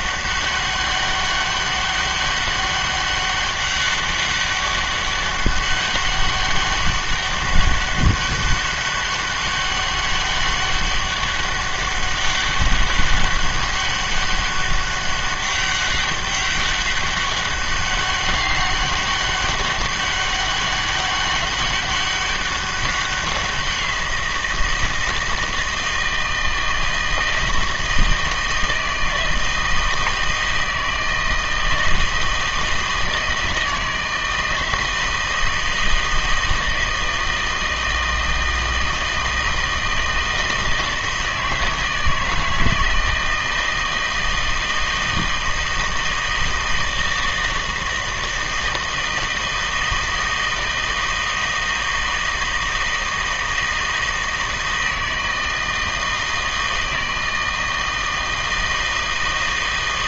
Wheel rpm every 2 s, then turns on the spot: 200, 200, 200, 200, 200, 200, 200, 200, 200, 200, 200, 190, 170, 160, 160, 160, 160, 160, 160, 160, 160, 160, 160, 160, 160, 160, 160, 160, 160, 160.
none